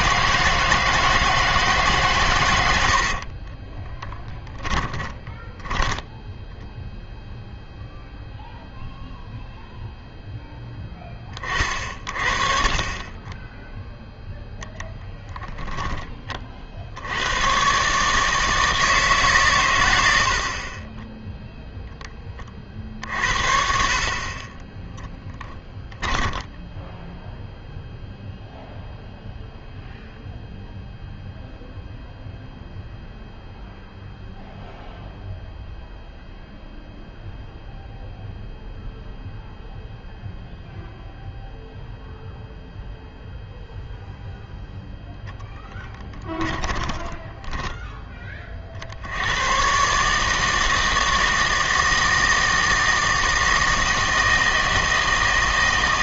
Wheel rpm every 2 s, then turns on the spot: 160, 100, 10, 0, 0, 10, 30, 10, 60, 160, 40, 40, 20, 10, 0, 0, 0, 0, 0, 0, 0, 0, 0, 20, 50, 160, 160, 160.
2-6 14-16 24-28 46-48